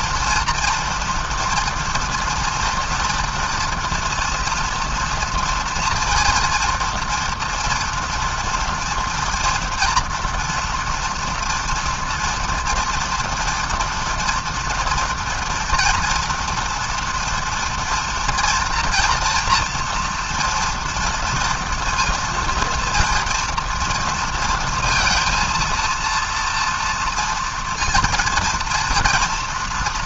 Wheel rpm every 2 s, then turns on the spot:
230, 230, 240, 230, 230, 230, 230, 240, 230, 230, 230, 230, 230, 230, 230.
none